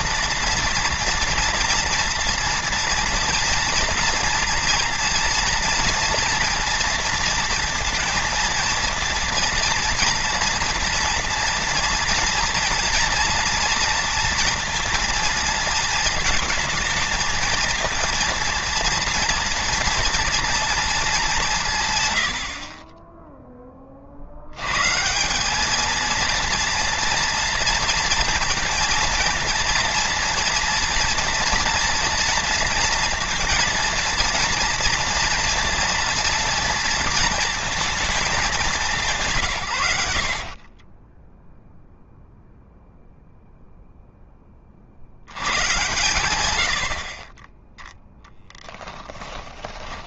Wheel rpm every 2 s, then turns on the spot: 230, 230, 230, 230, 230, 230, 230, 230, 220, 230, 220, 40, 130, 230, 230, 230, 230, 230, 230, 190, 20, 0, 50, 70, 10.
40-42 48-50